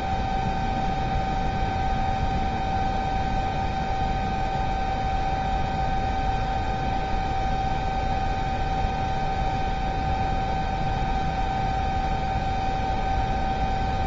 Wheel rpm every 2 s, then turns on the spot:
0, 0, 0, 0, 0, 0, 0.
none